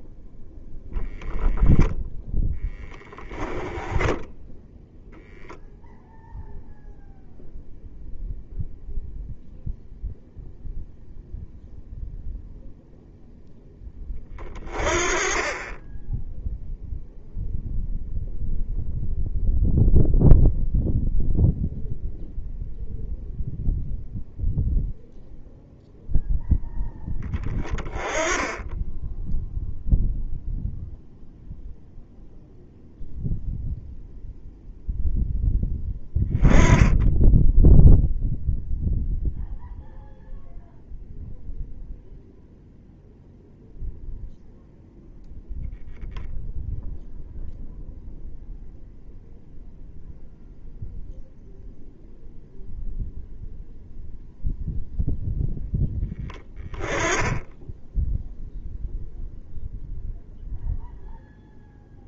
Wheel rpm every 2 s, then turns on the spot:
10, 10, 0, 0, 0, 0, 0, 40, 0, 0, 0, 0, 0, 0, 10, 0, 0, 0, 10, 0, 0, 0, 0, 0, 0, 0, 0, 0, 10, 0, 0.
0-2